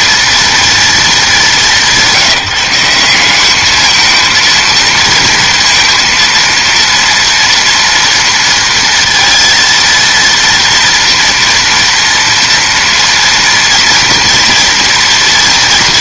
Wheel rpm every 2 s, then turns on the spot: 230, 180, 230, 230, 230, 230, 230, 230.
none